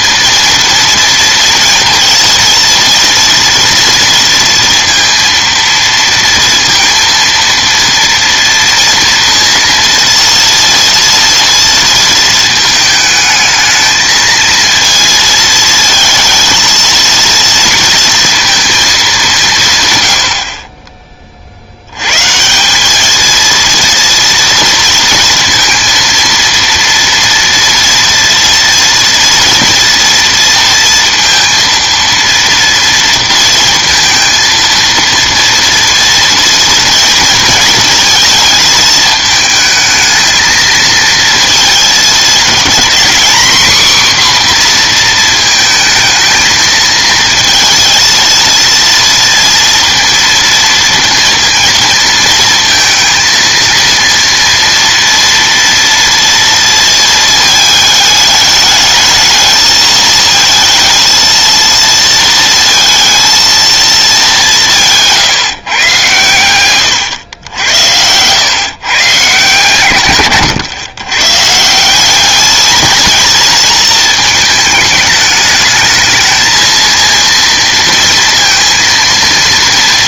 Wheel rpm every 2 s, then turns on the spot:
230, 230, 230, 230, 240, 230, 220, 220, 230, 230, 40, 160, 230, 230, 230, 230, 230, 230, 230, 220, 220, 230, 250, 220, 230, 230, 220, 230, 230, 210, 220, 230, 190, 120, 120, 120, 220, 220, 220, 230.
none